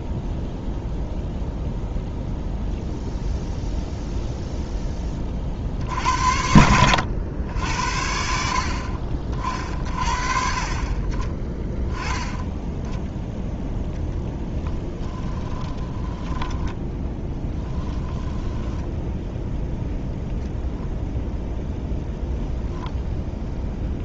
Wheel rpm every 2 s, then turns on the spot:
0, 0, 10, 90, 50, 30, 10, 10, 20, 10, 0, 0.
18-20